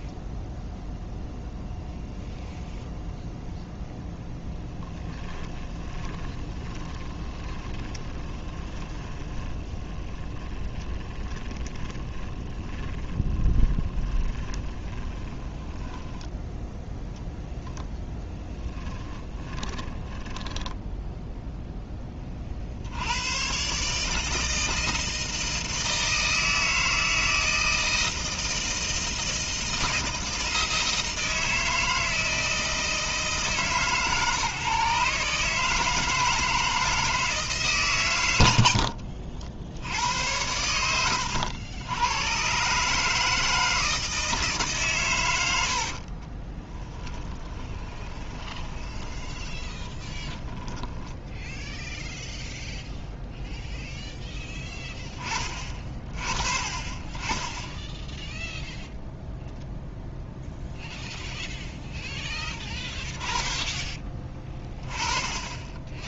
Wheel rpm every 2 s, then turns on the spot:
0, 0, 10, 20, 20, 30, 20, 20, 10, 20, 10, 50, 160, 160, 160, 160, 160, 140, 160, 100, 90, 130, 140, 20, 20, 10, 0, 10, 40, 0, 0, 10, 20.
4-16 18-22 38-40 46-52 62-64